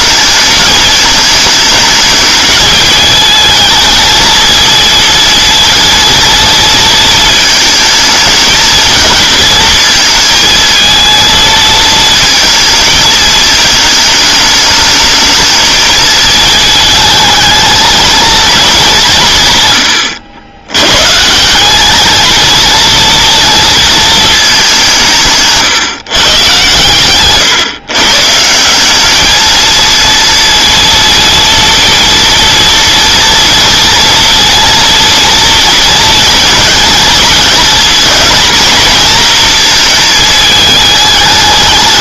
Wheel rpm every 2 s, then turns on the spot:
220, 220, 230, 230, 220, 230, 220, 220, 220, 210, 110, 230, 180, 130, 180, 230, 230, 230, 220, 240, 220.
none